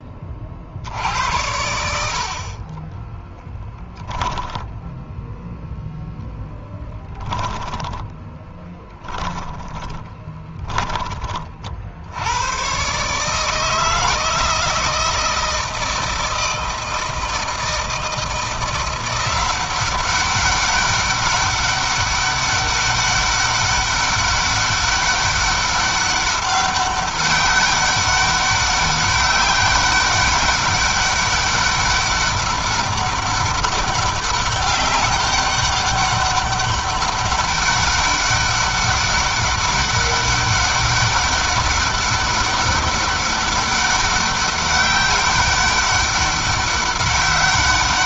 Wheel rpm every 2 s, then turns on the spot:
50, 40, 0, 10, 10, 20, 130, 160, 160, 170, 200, 200, 200, 190, 200, 200, 200, 200, 200, 200, 200, 200, 200, 200.
6-10